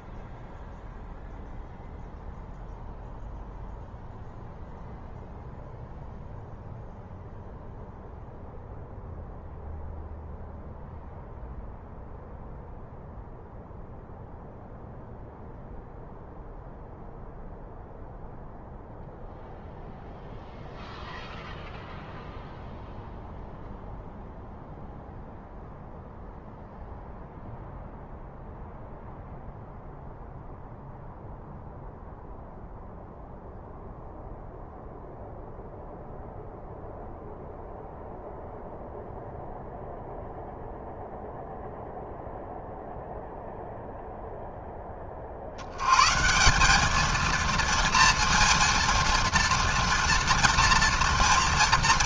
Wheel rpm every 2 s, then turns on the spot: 0, 0, 0, 0, 0, 0, 0, 0, 0, 0, 0, 0, 0, 0, 0, 0, 0, 0, 0, 0, 0, 0, 0, 180, 230, 230.
none